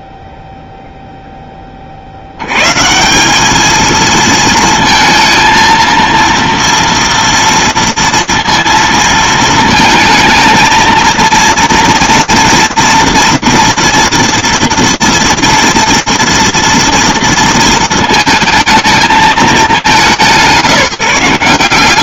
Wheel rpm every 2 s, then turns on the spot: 0, 0, 190, 230, 230, 220, 230, 230, 230, 220, 170.
none